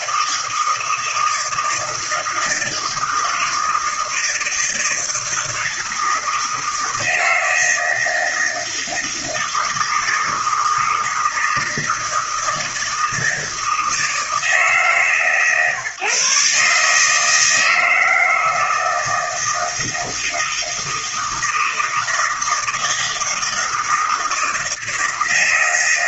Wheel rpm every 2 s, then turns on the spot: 160, 160, 160, 160, 160, 160, 160, 160, 140, 160, 160, 160, 160.
none